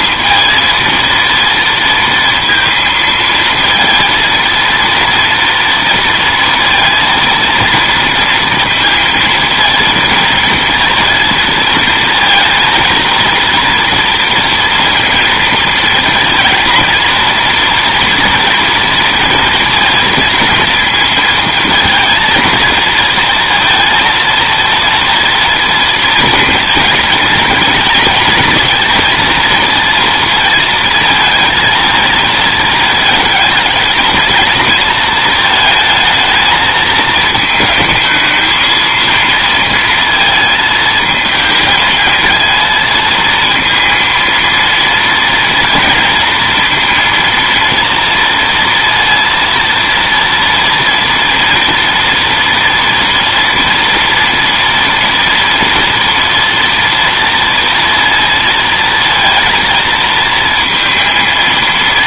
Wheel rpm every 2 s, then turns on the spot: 230, 230, 230, 230, 230, 230, 230, 230, 230, 230, 230, 230, 230, 230, 220, 230, 220, 220, 220, 220, 230, 220, 230, 230, 230, 230, 230, 240, 230, 230, 230.
none